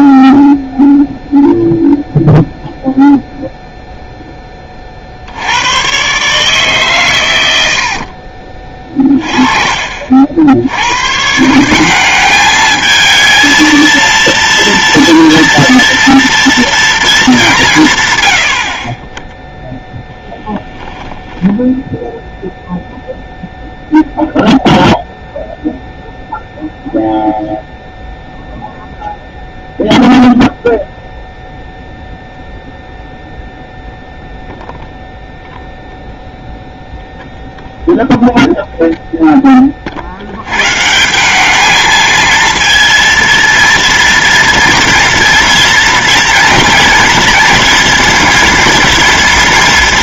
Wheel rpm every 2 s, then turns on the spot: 0, 0, 30, 150, 40, 90, 210, 230, 230, 40, 10, 0, 0, 0, 0, 0, 0, 0, 0, 0, 130, 230, 230, 230, 230.
none